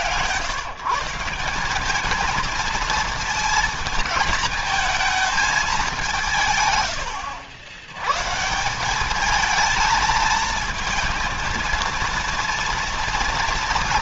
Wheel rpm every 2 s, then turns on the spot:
130, 220, 220, 150, 160, 230, 230.
none